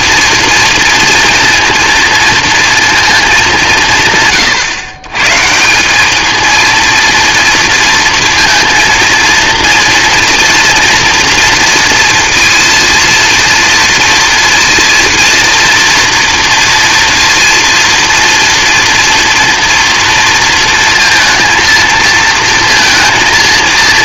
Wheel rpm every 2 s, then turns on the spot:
230, 230, 130, 230, 230, 230, 230, 230, 230, 230, 230, 230.
none